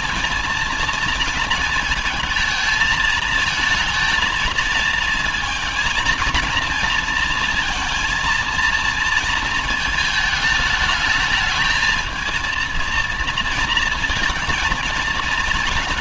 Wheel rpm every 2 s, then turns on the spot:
220, 220, 230, 230, 230, 210, 230, 230.
none